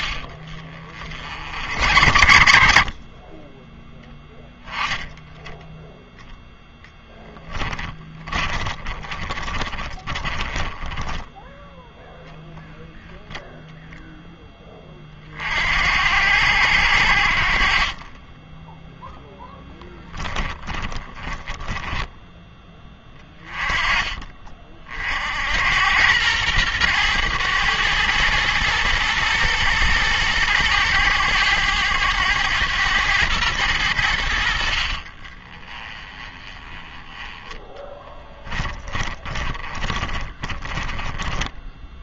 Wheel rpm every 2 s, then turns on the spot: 60, 50, 20, 0, 20, 10, 0, 20, 80, 10, 20, 10, 40, 110, 110, 110, 110, 50, 20, 20, 20.
0-2 8-12 20-22 34-42